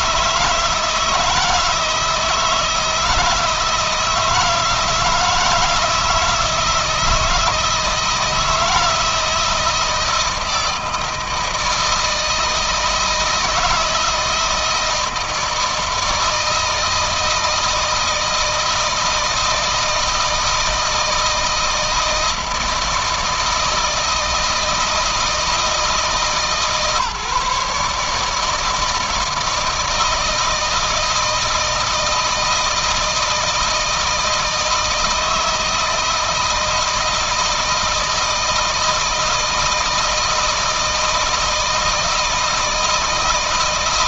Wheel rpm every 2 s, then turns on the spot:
160, 160, 160, 160, 160, 160, 160, 160, 160, 170, 160, 160, 160, 150, 160, 160, 160, 160, 160, 160, 160, 160.
none